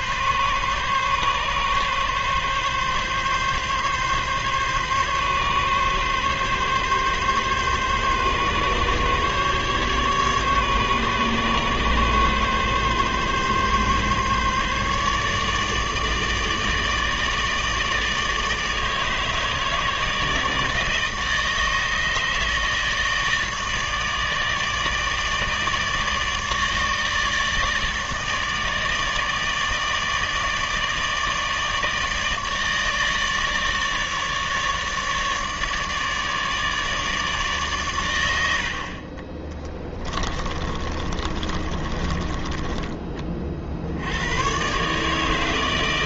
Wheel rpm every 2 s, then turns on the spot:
140, 140, 140, 140, 140, 140, 140, 140, 150, 150, 160, 160, 150, 150, 160, 150, 160, 150, 150, 70, 30, 20, 120.
40-44